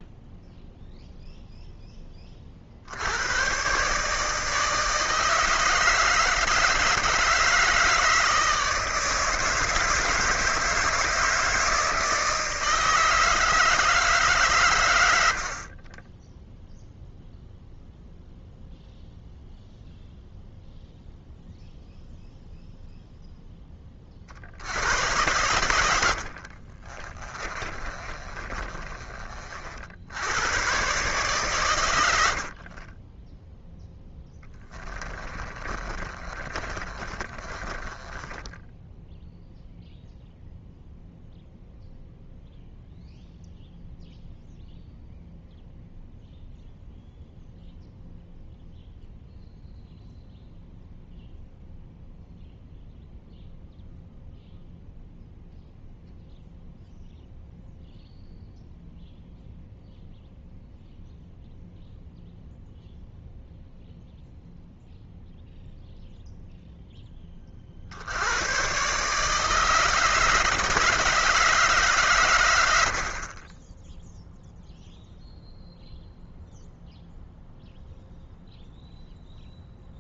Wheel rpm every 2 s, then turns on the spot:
0, 50, 160, 160, 160, 160, 160, 110, 0, 0, 0, 0, 90, 40, 30, 120, 40, 20, 30, 10, 0, 0, 0, 0, 0, 0, 0, 0, 0, 0, 0, 0, 0, 0, 120, 160, 90, 0, 0, 0.
26-30 32-40